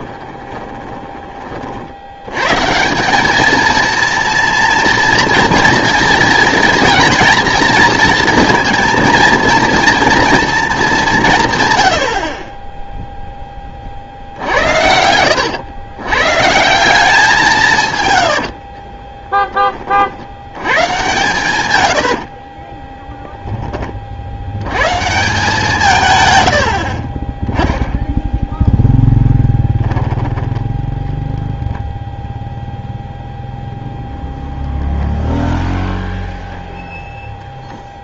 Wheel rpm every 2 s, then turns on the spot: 20, 150, 230, 230, 230, 220, 10, 80, 170, 50, 110, 30, 110, 60, 0, 10, 0, 0, 0.
0-2 18-20 22-24 26-28